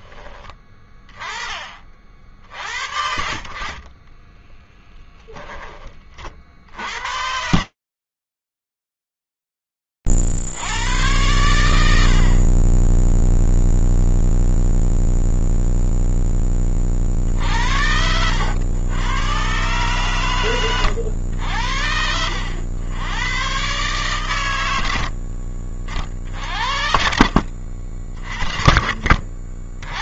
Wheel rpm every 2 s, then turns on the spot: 20, 60, 10, 60, 0, 60, 50, 0, 20, 90, 120, 100, 100, 60, 40.
none